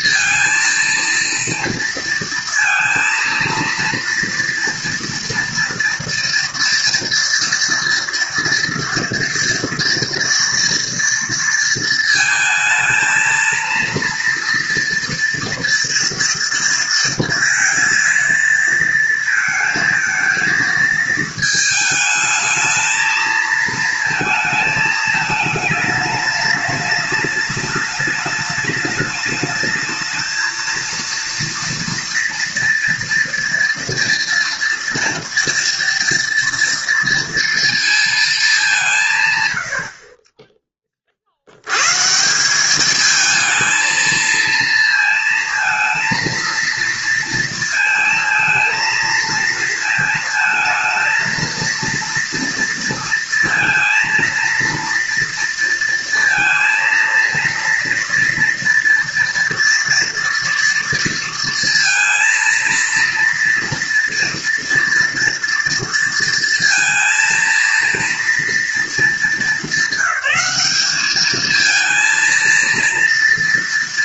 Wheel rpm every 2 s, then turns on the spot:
230, 230, 230, 230, 230, 230, 220, 240, 230, 230, 230, 220, 220, 210, 210, 230, 240, 230, 230, 190, 20, 180, 220, 230, 230, 220, 230, 230, 230, 240, 230, 230, 240, 230, 220, 200, 230.
none